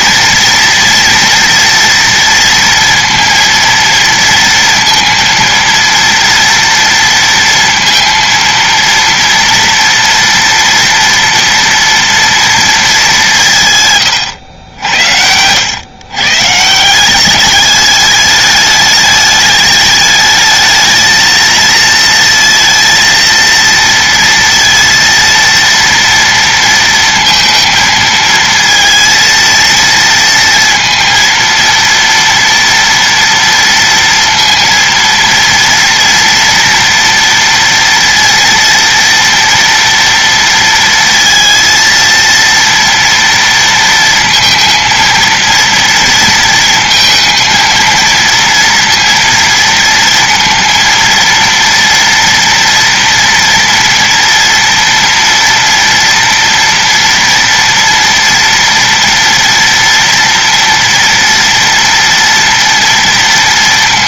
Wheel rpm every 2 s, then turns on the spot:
240, 230, 230, 230, 230, 240, 230, 90, 170, 210, 220, 230, 230, 230, 230, 230, 230, 230, 230, 230, 230, 230, 230, 230, 230, 230, 230, 230, 230, 230, 240, 230.
none